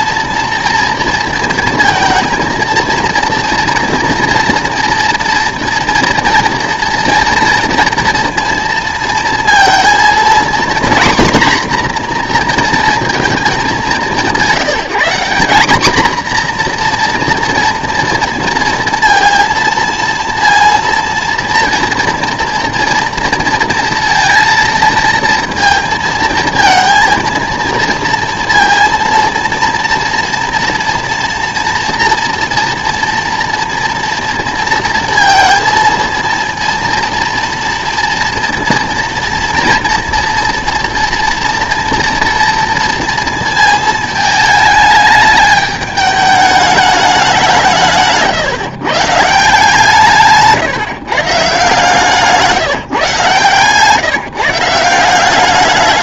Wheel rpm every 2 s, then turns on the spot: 230, 220, 230, 230, 230, 240, 240, 190, 250, 230, 230, 230, 230, 230, 230, 240, 230, 230, 230, 230, 230, 240, 220, 210, 150, 140, 160, 160.
none